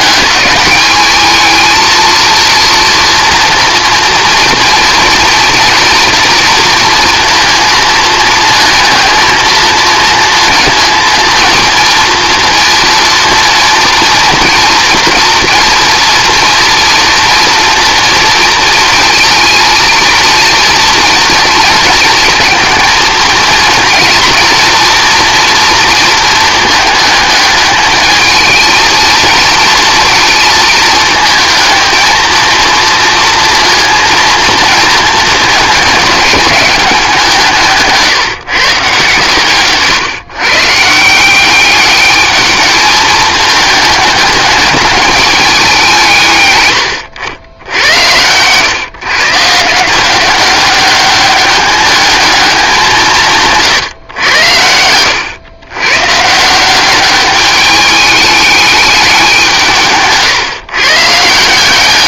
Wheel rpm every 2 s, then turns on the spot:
210, 230, 230, 230, 220, 230, 230, 230, 230, 230, 230, 220, 230, 220, 220, 230, 230, 230, 200, 140, 150, 210, 210, 120, 130, 200, 200, 90, 180, 210, 130.
none